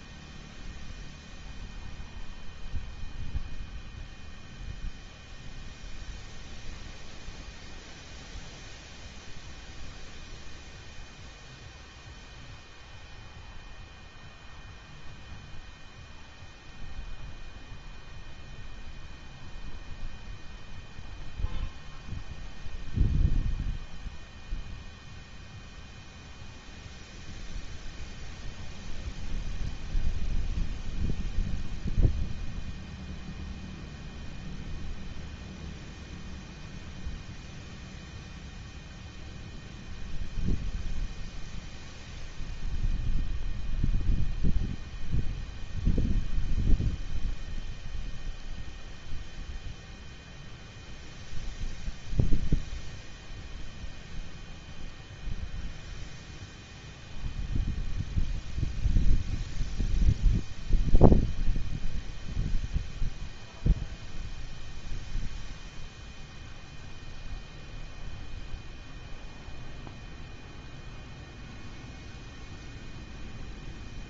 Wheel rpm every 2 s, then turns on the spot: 0, 0, 0, 0, 0, 0, 0, 0, 0, 0, 0, 0, 0, 0, 0, 0, 0, 0, 0, 0, 0, 0, 0, 0, 0, 0, 0, 0, 0, 0, 0, 0, 0, 0, 0, 0, 0.
none